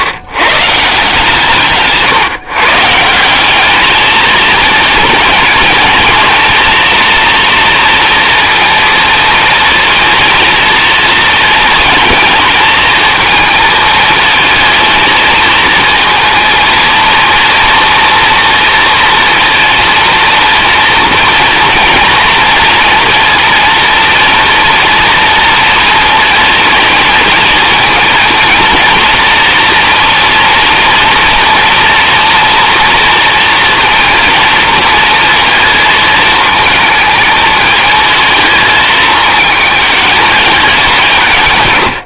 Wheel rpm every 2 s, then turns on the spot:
150, 150, 230, 230, 230, 230, 220, 220, 230, 230, 230, 230, 230, 220, 230, 230, 230, 230, 220, 220, 200.
none